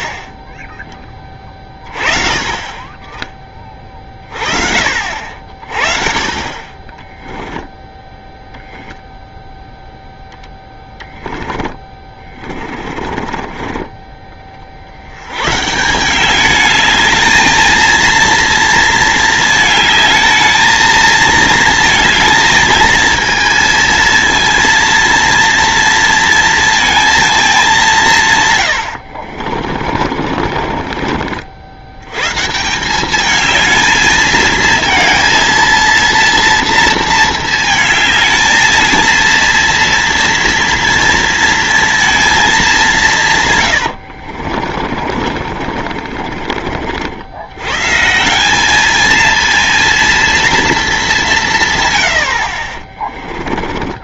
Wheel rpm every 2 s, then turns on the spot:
10, 20, 40, 20, 0, 10, 30, 50, 200, 230, 220, 230, 230, 230, 120, 50, 170, 230, 230, 220, 230, 210, 40, 50, 200, 220, 50.
6-8 10-14 28-32 44-46 52-54